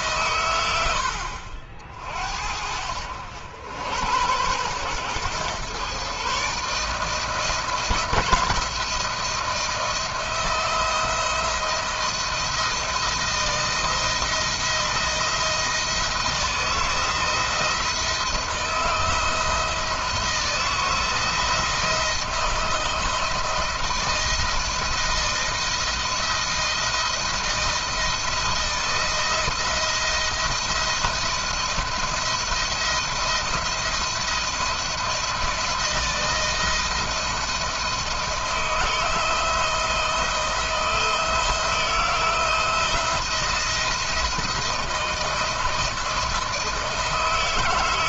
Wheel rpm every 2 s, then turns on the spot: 90, 70, 110, 150, 160, 170, 170, 160, 170, 160, 170, 160, 160, 170, 170, 170, 170, 170, 160, 160, 160, 160, 170, 170.
none